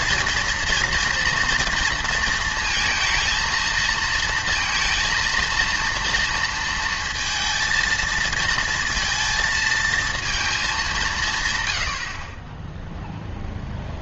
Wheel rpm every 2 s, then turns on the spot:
240, 230, 220, 230, 230, 220, 10.
none